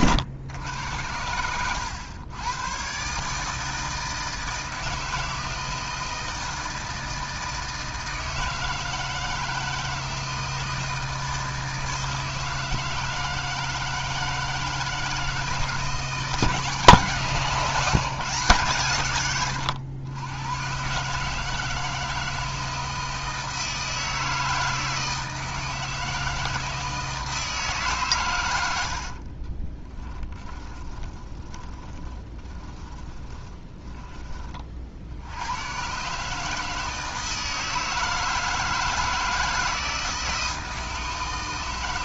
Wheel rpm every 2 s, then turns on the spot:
90, 120, 160, 160, 160, 160, 160, 160, 150, 130, 130, 160, 160, 160, 90, 20, 20, 50, 160, 160, 160.
28-34